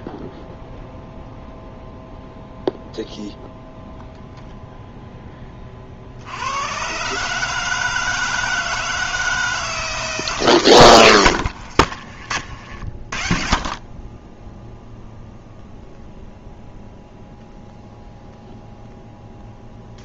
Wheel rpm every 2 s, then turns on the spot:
0, 0, 10, 140, 160, 100, 50, 0, 0, 0.
none